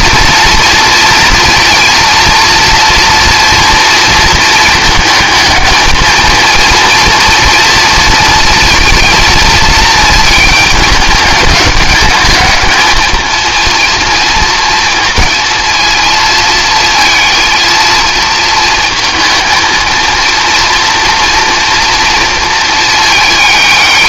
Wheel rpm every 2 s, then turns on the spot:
230, 230, 230, 230, 230, 220, 210, 230, 230, 230, 230, 230.
none